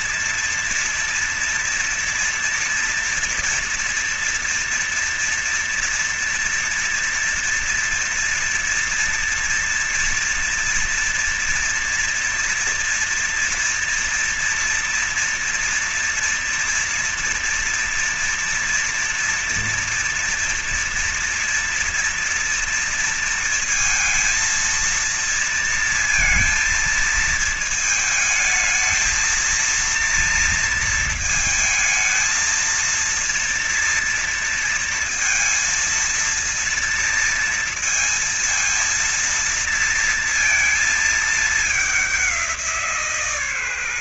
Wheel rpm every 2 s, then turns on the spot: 230, 230, 230, 230, 230, 240, 240, 230, 230, 230, 230, 230, 230, 230, 220, 230, 220, 230, 230, 230, 230, 200.
none